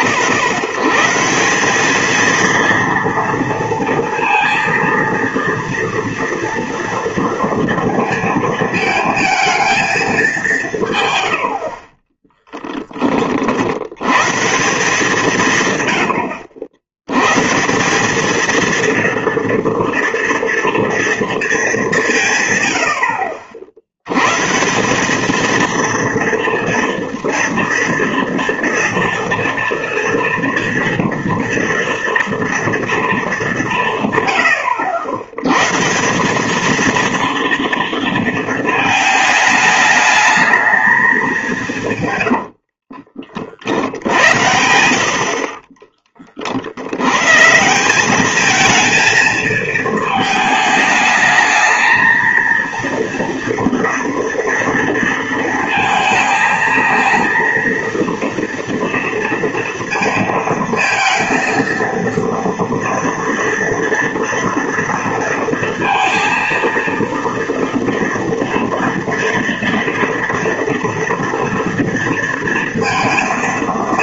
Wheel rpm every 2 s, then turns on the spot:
70, 230, 230, 230, 230, 170, 10, 160, 80, 220, 230, 110, 150, 230, 230, 230, 230, 100, 210, 220, 220, 60, 80, 70, 220, 210, 230, 230, 220, 230, 230, 230, 230, 230, 230, 230, 230.
42-44